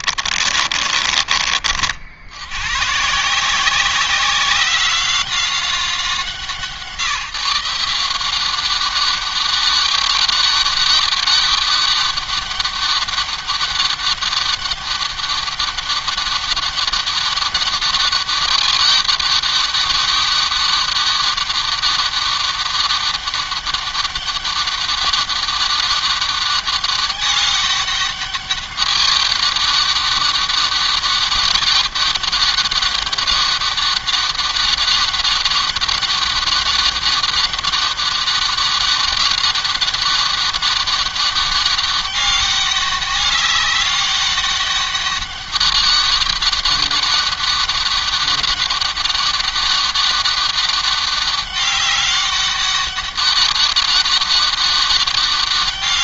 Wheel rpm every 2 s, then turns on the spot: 30, 140, 190, 160, 190, 200, 200, 200, 190, 200, 200, 190, 200, 200, 200, 200, 200, 200, 200, 200, 200, 200, 200, 200, 200, 200, 200, 200.
0-2